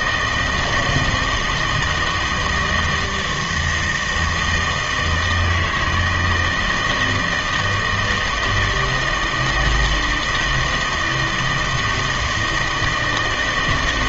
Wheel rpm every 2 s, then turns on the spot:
160, 160, 160, 160, 160, 160, 160.
none